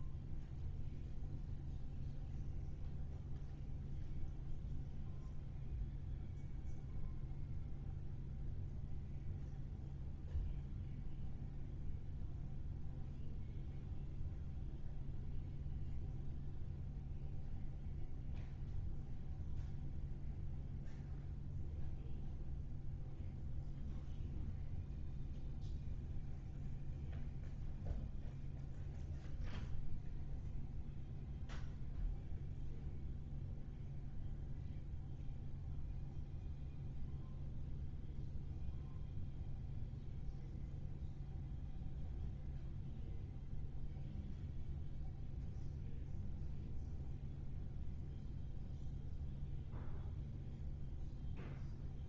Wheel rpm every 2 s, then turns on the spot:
0, 0, 0, 0, 0, 0, 0, 0, 0, 0, 0, 0, 0, 0, 0, 0, 0, 0, 0, 0, 0, 0, 0, 0, 0, 0.
none